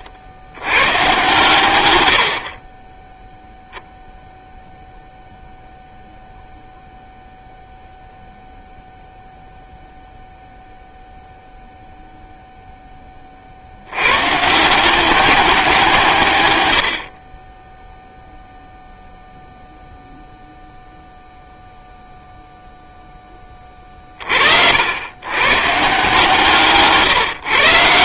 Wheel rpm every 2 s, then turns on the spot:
110, 10, 0, 0, 0, 0, 10, 180, 90, 0, 0, 0, 80, 150.
26-28